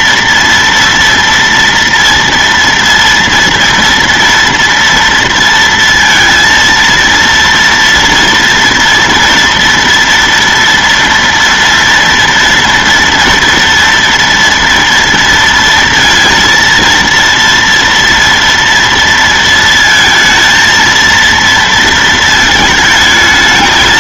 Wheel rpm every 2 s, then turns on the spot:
230, 230, 230, 230, 230, 230, 230, 230, 230, 230, 230, 220.
none